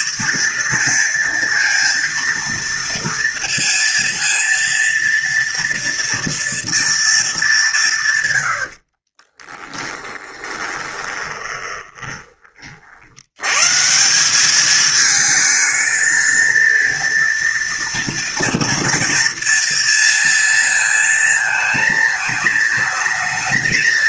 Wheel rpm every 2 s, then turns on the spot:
230, 230, 230, 230, 100, 20, 30, 200, 230, 230, 230, 220.
10-12